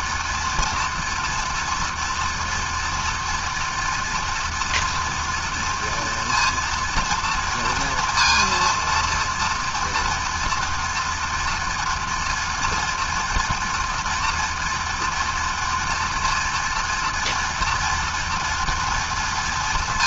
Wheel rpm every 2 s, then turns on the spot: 230, 230, 230, 230, 230, 230, 240, 240, 230, 240.
none